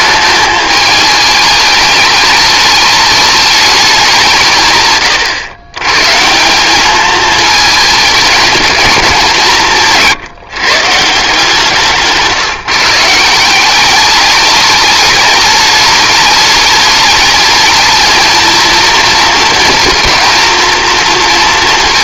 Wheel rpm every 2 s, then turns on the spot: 210, 210, 110, 220, 200, 160, 170, 210, 210, 230, 230.
none